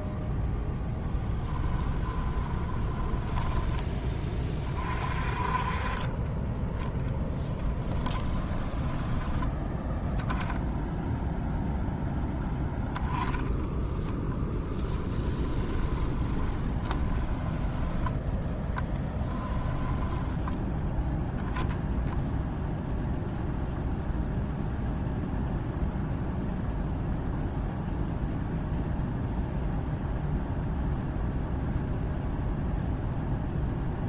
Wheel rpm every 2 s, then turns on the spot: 10, 20, 40, 10, 10, 0, 10, 10, 20, 10, 10, 0, 0, 0, 0, 0, 0.
2-4 8-10 12-14 16-18 20-22